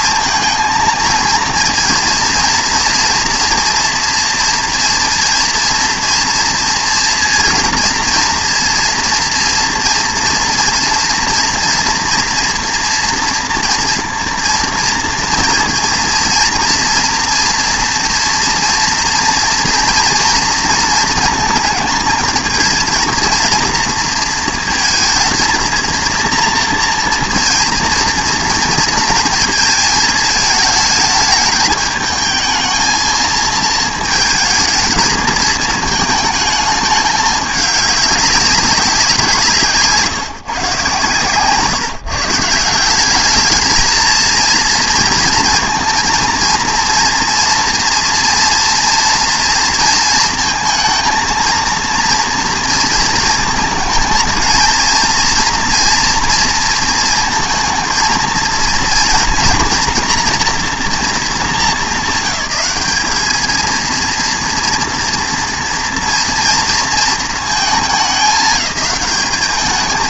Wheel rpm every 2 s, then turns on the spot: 230, 230, 230, 230, 230, 230, 230, 230, 230, 240, 230, 220, 230, 230, 230, 210, 220, 220, 210, 190, 140, 170, 230, 230, 230, 230, 230, 230, 230, 230, 240, 200, 230, 230, 200.
none